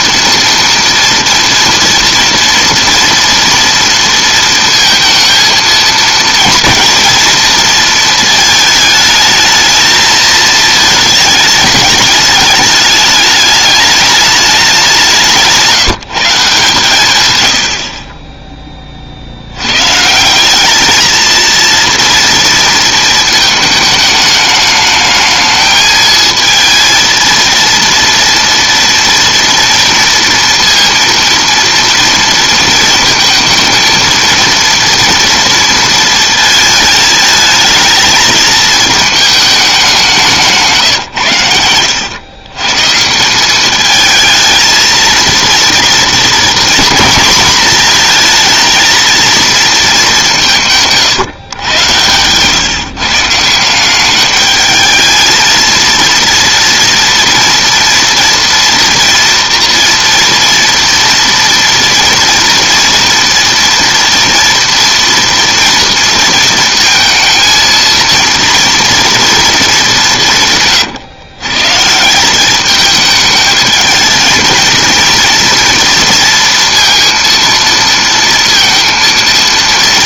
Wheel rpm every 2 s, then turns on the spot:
230, 240, 230, 230, 220, 220, 210, 200, 150, 20, 190, 230, 210, 220, 230, 230, 230, 230, 220, 220, 170, 130, 220, 240, 230, 160, 130, 210, 230, 230, 230, 230, 240, 230, 230, 140, 200, 230, 230, 230.
none